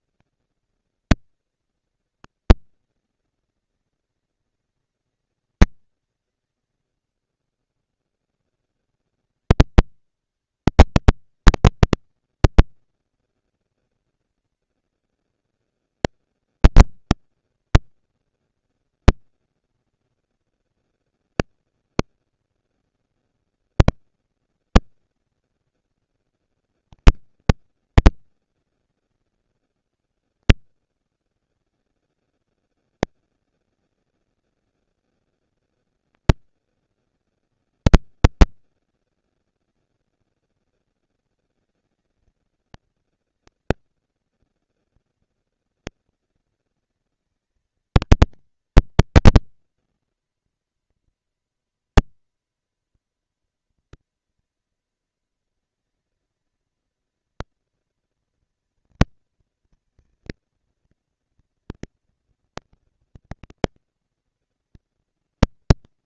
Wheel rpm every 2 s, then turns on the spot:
230, 230, 230, 180, 90, 210, 220, 230, 230, 240, 240, 230, 220, 220, 190, 100, 190, 220, 230, 230, 230, 220, 230, 230, 230, 230, 230, 230, 230, 230, 230, 230, 230.
none